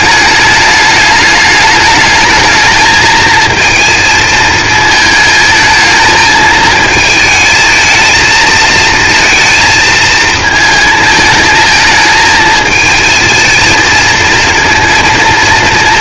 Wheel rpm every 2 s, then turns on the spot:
210, 220, 220, 220, 230, 220, 220, 230.
none